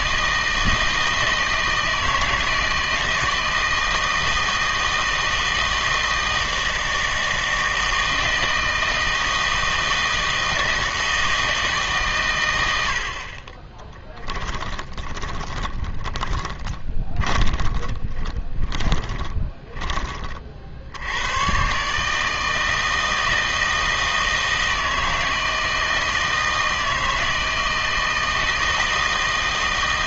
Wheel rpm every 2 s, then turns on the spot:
160, 160, 160, 160, 160, 160, 100, 20, 20, 20, 60, 160, 160, 160, 160.
14-20